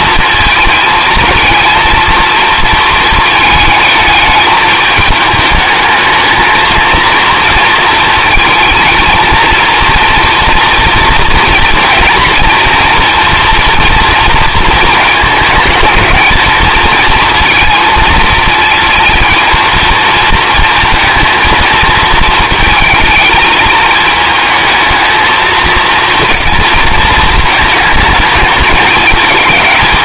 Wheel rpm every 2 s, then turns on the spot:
230, 220, 210, 230, 230, 240, 240, 230, 230, 230, 230, 220, 220, 230, 210.
none